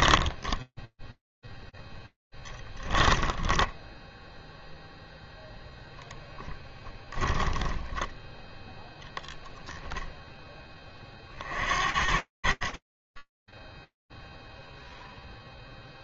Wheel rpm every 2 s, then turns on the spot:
0, 10, 0, 10, 0, 80, 0, 0.
2-4 6-8